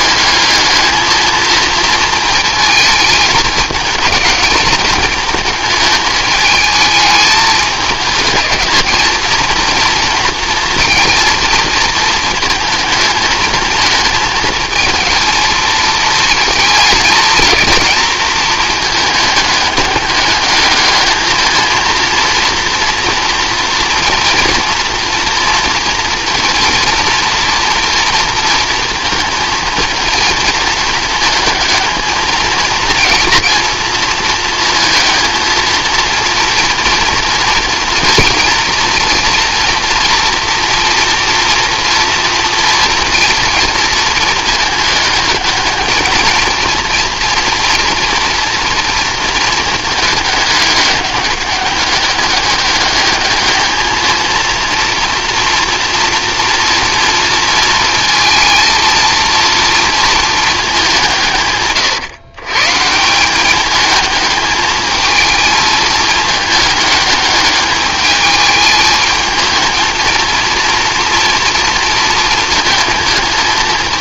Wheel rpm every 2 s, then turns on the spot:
220, 220, 220, 220, 220, 230, 220, 220, 220, 220, 210, 230, 230, 230, 220, 230, 230, 230, 230, 230, 230, 230, 210, 230, 230, 210, 210, 230, 230, 230, 200, 150, 220, 210, 220, 230, 220.
none